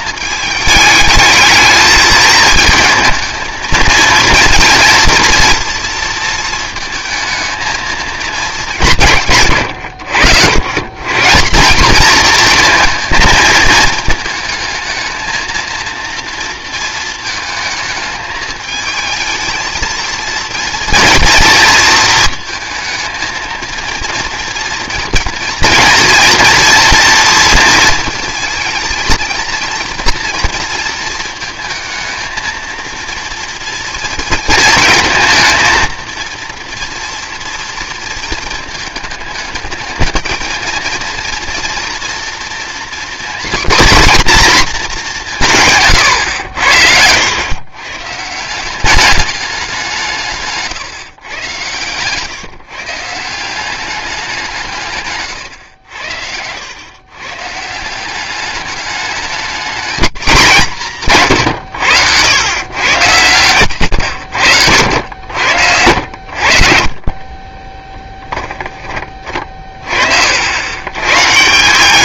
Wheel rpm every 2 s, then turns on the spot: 210, 220, 230, 220, 200, 110, 230, 220, 230, 220, 230, 230, 240, 240, 220, 230, 220, 220, 240, 220, 230, 240, 220, 80, 190, 150, 140, 160, 100, 210, 180, 110, 90, 60, 10, 100.
none